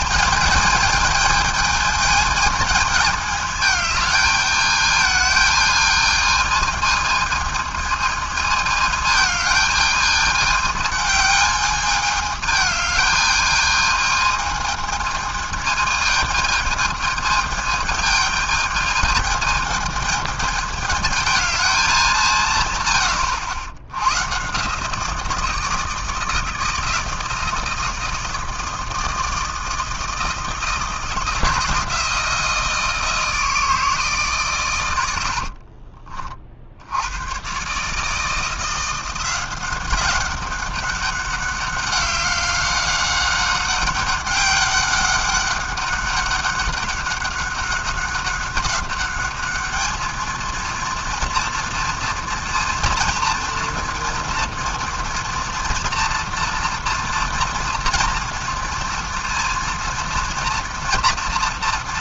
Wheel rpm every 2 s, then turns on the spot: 220, 220, 210, 220, 220, 210, 210, 220, 220, 220, 220, 120, 150, 160, 160, 160, 160, 100, 70, 170, 200, 190, 200, 200, 200, 230, 230, 230, 230, 230, 230.
none